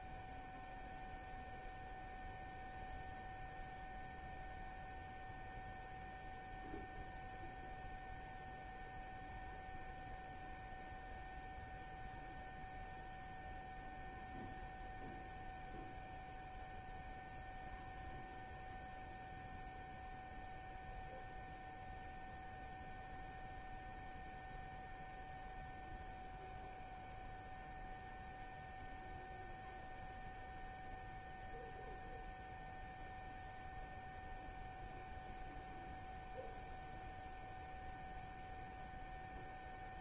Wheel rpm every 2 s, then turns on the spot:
0, 0, 0, 0, 0, 0, 0, 0, 0, 0, 0, 0, 0, 0, 0, 0, 0, 0, 0, 0.
none